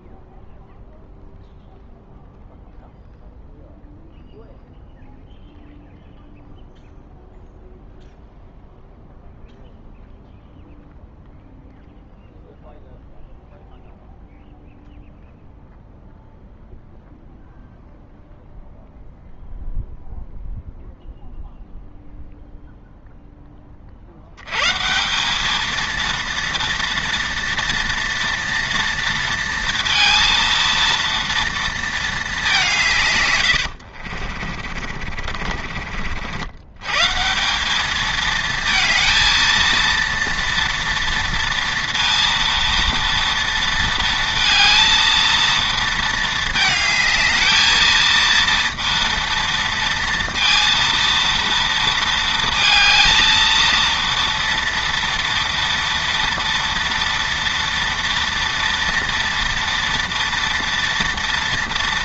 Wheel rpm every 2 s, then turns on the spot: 0, 0, 0, 0, 0, 0, 0, 0, 0, 0, 0, 0, 110, 230, 230, 230, 180, 40, 90, 220, 230, 230, 230, 220, 230, 230, 230, 230, 230, 230, 230.
34-36